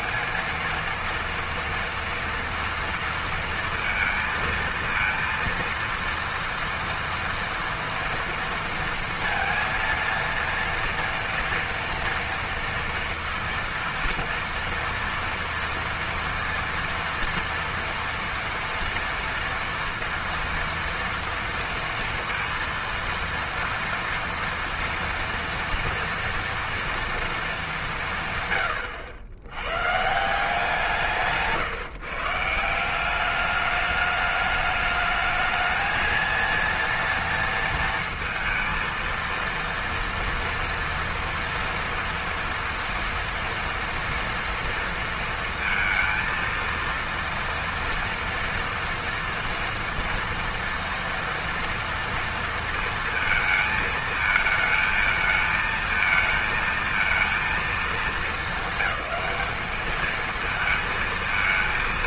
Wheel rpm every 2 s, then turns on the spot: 220, 230, 230, 230, 230, 230, 230, 230, 230, 230, 230, 230, 230, 230, 110, 170, 160, 210, 230, 230, 230, 230, 230, 230, 230, 230, 230, 220, 220, 210, 220.
none